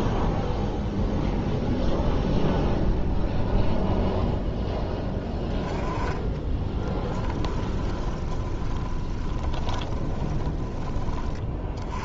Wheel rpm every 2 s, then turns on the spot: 0, 0, 10, 20, 20, 30.
6-10